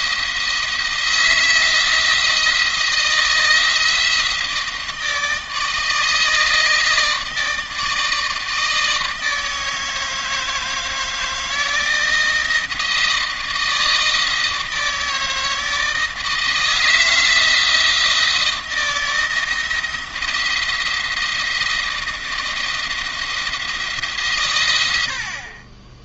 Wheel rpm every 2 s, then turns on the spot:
170, 170, 160, 160, 160, 160, 160, 160, 160, 160, 170, 170, 90.
none